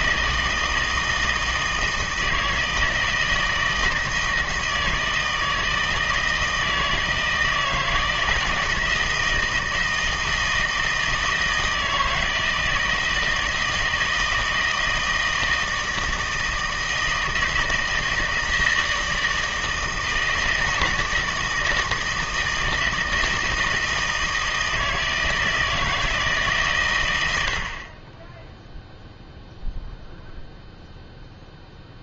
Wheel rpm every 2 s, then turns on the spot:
160, 160, 160, 160, 160, 160, 160, 160, 160, 160, 160, 160, 160, 140, 0, 0.
none